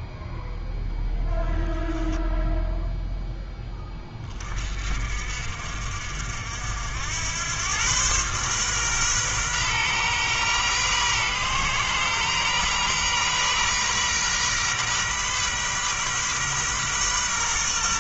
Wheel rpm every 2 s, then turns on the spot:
0, 0, 50, 80, 130, 120, 130, 130, 130.
none